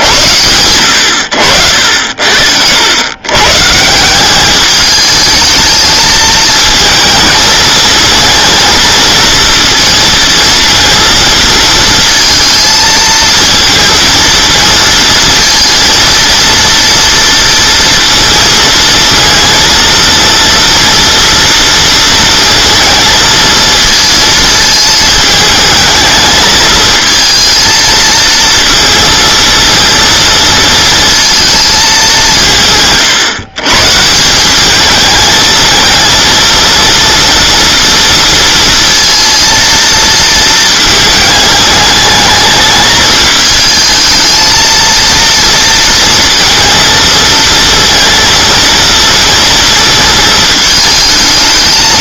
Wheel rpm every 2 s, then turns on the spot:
90, 90, 210, 220, 230, 230, 220, 230, 230, 230, 230, 230, 220, 220, 230, 230, 150, 200, 230, 230, 220, 210, 230, 230, 230, 220.
none